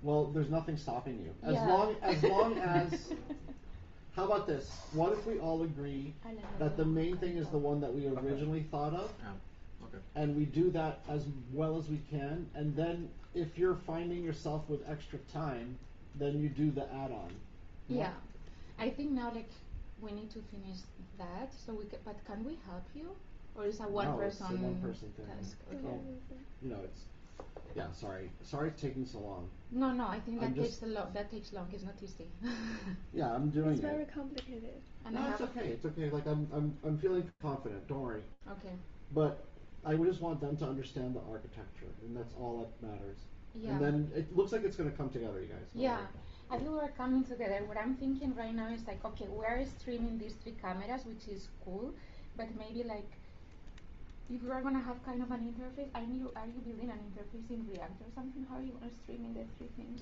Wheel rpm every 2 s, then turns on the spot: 0, 0, 0, 0, 0, 0, 0, 0, 0, 0, 0, 0, 0, 0, 0, 0, 0, 0, 0, 0, 0, 0, 0, 0, 0, 0, 0, 0, 0, 0.
none